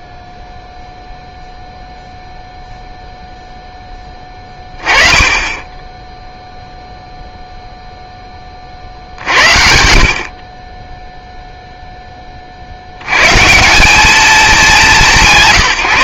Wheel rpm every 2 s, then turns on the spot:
0, 0, 20, 0, 40, 20, 50, 210.
none